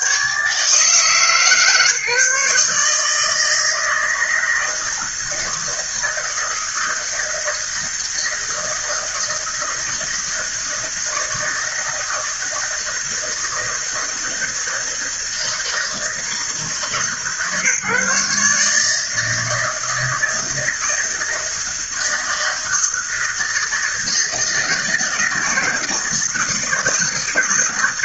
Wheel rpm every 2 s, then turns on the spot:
150, 150, 160, 160, 160, 160, 160, 160, 150, 150, 160, 160, 160, 160.
none